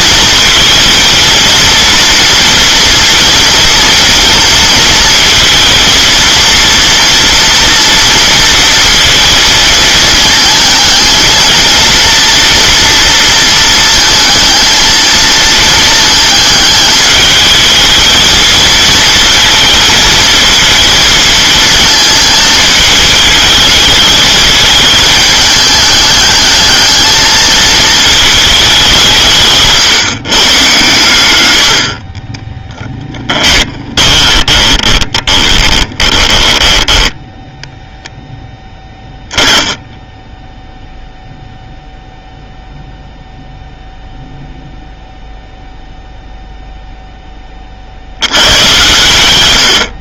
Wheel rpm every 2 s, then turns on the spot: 230, 230, 230, 230, 230, 220, 230, 230, 220, 220, 220, 220, 210, 210, 210, 130, 20, 30, 10, 10, 0, 0, 0, 0, 120.
32-38